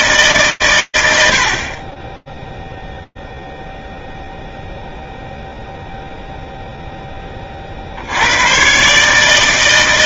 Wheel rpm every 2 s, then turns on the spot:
60, 0, 0, 90, 120.
none